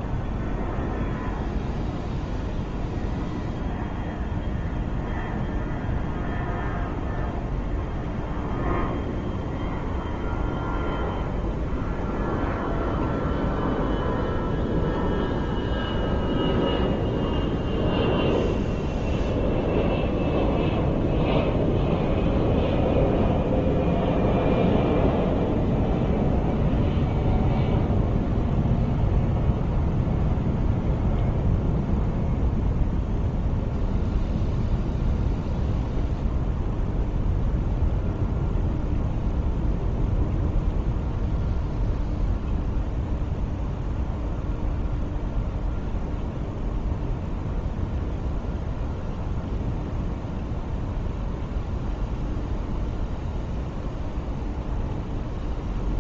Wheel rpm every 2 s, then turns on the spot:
0, 0, 0, 0, 0, 0, 0, 0, 0, 0, 0, 0, 0, 0, 0, 0, 0, 0, 0, 0, 0, 0, 0, 0, 0, 0, 0, 0.
none